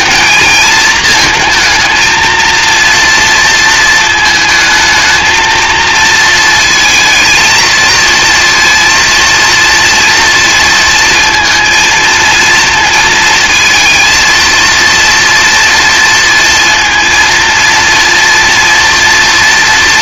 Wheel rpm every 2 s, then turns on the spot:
220, 230, 220, 220, 230, 230, 230, 230, 230, 230.
none